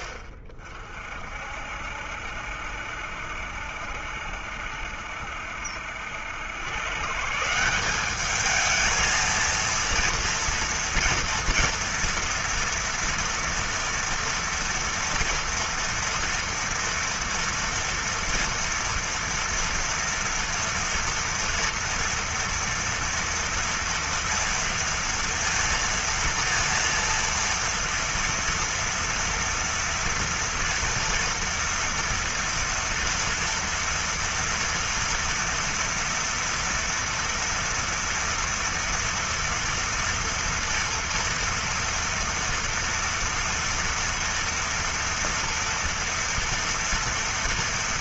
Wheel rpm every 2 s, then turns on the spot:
80, 70, 60, 110, 210, 230, 240, 230, 230, 230, 230, 230, 230, 230, 230, 230, 230, 230, 230, 230, 230, 230, 230, 230.
none